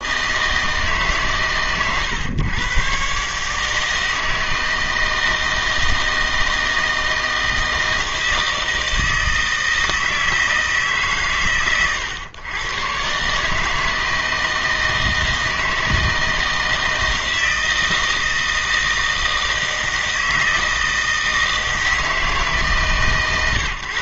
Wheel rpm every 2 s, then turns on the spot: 160, 120, 160, 160, 160, 160, 120, 160, 160, 160, 160, 140.
none